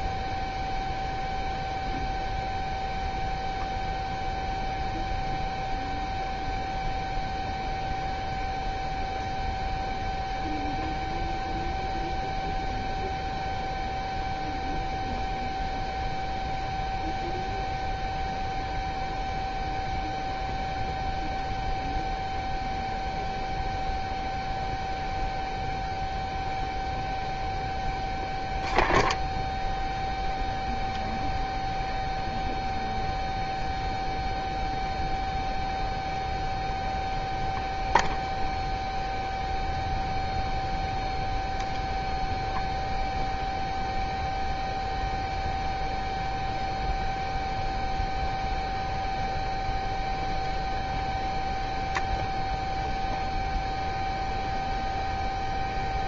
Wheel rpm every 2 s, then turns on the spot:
0, 0, 0, 0, 0, 0, 0, 0, 0, 0, 0, 0, 0, 0, 0, 0, 0, 0, 0, 0, 0, 0, 0, 0, 0, 0, 0, 0.
none